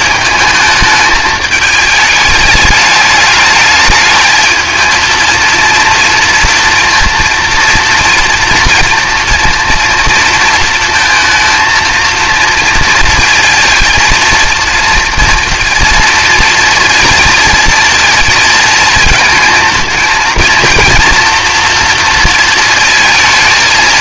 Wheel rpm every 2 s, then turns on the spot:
210, 210, 220, 230, 230, 230, 230, 230, 230, 220, 230, 220.
none